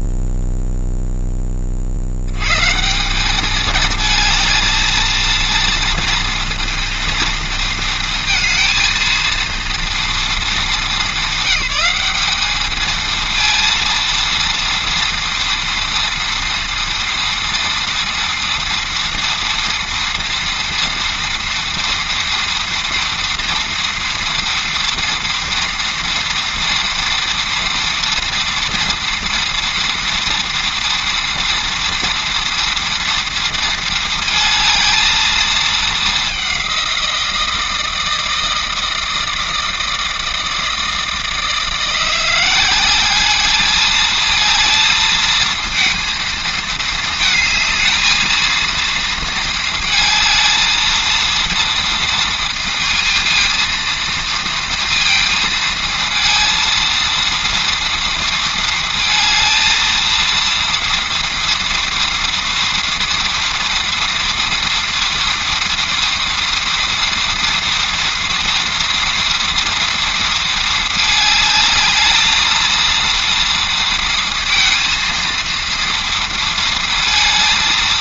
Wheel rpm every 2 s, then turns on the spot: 0, 170, 220, 230, 230, 210, 210, 230, 230, 230, 230, 230, 230, 230, 230, 230, 230, 220, 190, 160, 160, 190, 220, 220, 230, 220, 230, 230, 230, 230, 230, 230, 230, 230, 230, 220, 230, 230, 230.
none